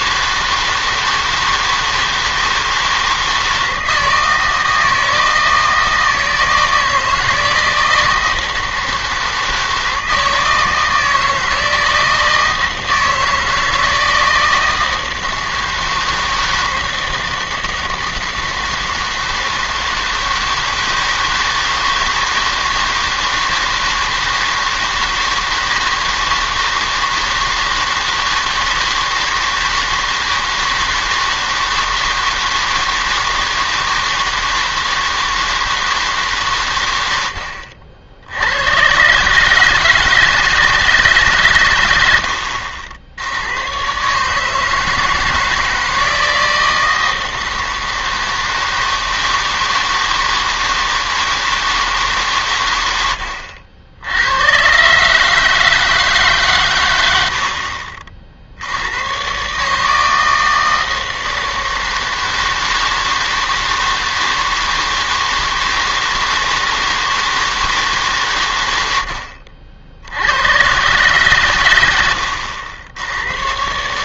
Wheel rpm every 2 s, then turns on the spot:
160, 160, 160, 160, 160, 160, 160, 160, 160, 160, 160, 160, 160, 160, 160, 160, 160, 160, 140, 90, 160, 70, 150, 160, 160, 160, 110, 110, 130, 70, 160, 160, 160, 160, 110, 100, 80.
none